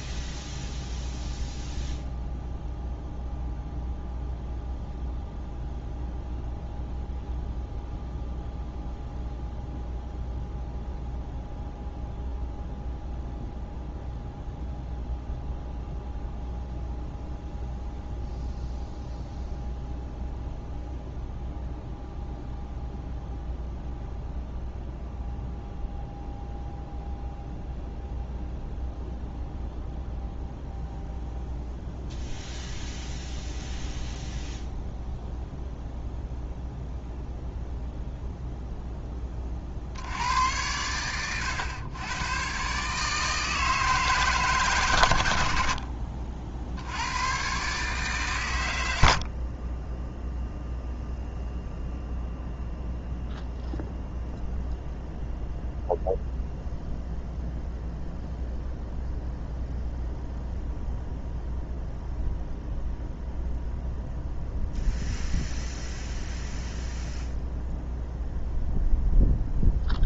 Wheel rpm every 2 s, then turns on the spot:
0, 0, 0, 0, 0, 0, 0, 0, 0, 0, 0, 0, 0, 0, 0, 0, 0, 0, 0, 0, 90, 130, 140, 60, 110, 0, 0, 0, 0, 0, 0, 0, 0, 0, 0.
none